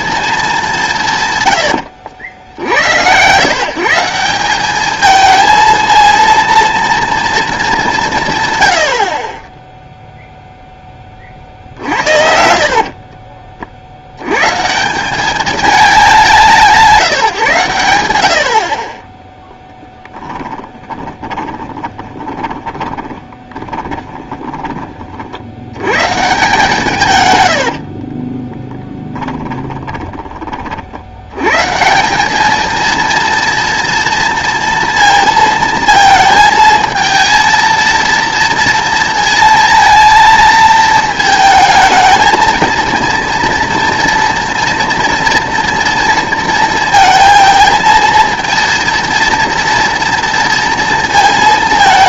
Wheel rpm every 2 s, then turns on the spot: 200, 80, 190, 230, 120, 0, 50, 140, 180, 50, 10, 20, 20, 160, 30, 40, 210, 230, 220, 230, 230, 230, 230, 230, 230, 230.
12-14 20-26 28-30